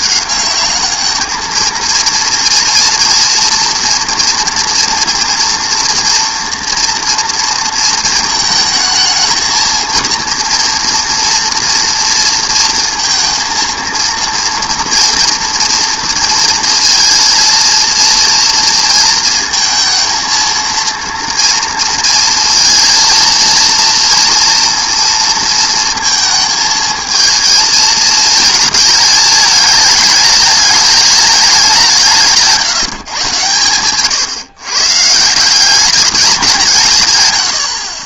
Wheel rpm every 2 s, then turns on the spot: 210, 230, 230, 230, 220, 230, 230, 240, 230, 230, 230, 230, 230, 220, 220, 210, 160, 130, 170.
none